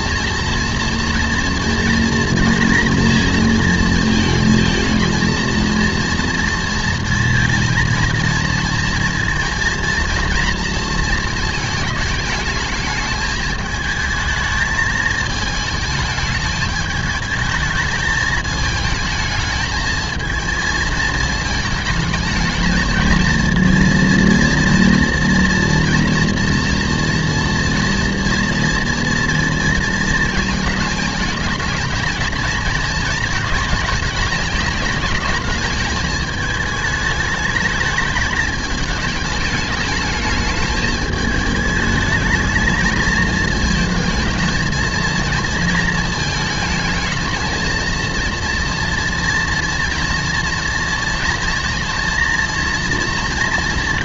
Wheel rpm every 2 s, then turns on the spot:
240, 230, 230, 230, 230, 230, 220, 220, 220, 220, 220, 220, 230, 230, 230, 220, 220, 210, 210, 220, 210, 220, 230, 220, 230, 230, 230.
none